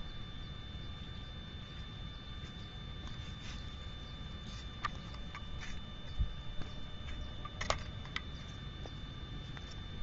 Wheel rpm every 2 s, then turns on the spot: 0, 0, 0, 0, 0.
none